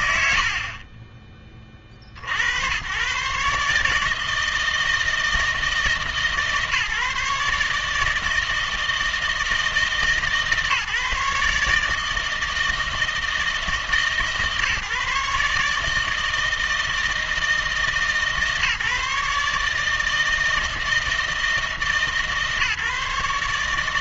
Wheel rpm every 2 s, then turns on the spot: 70, 90, 160, 140, 160, 140, 160, 150, 160, 150, 160, 150.
none